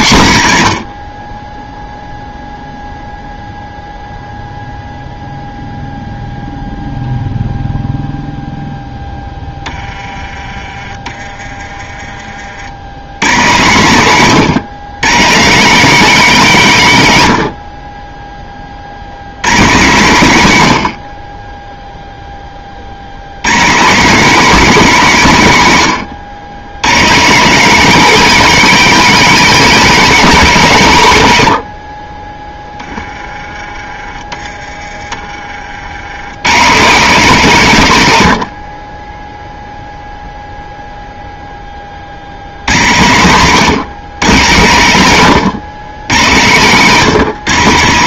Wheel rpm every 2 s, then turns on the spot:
80, 0, 0, 0, 0, 20, 90, 140, 150, 50, 80, 50, 200, 130, 240, 170, 10, 30, 150, 30, 0, 120, 120, 140.
none